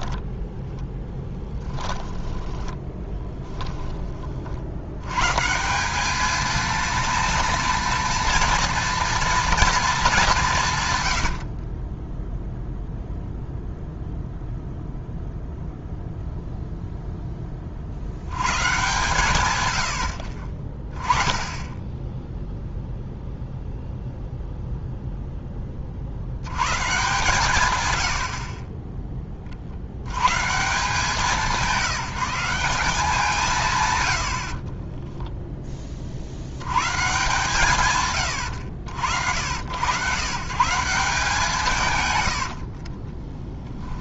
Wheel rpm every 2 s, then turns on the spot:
10, 10, 50, 230, 230, 140, 0, 0, 0, 130, 30, 0, 0, 120, 30, 160, 180, 40, 100, 90, 160, 50.
0-4 34-36 42-44